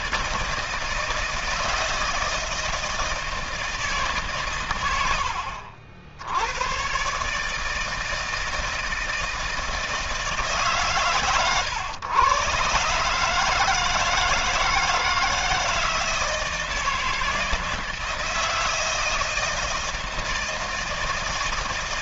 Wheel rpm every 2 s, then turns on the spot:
160, 160, 100, 130, 160, 140, 140, 160, 160, 160, 160.
none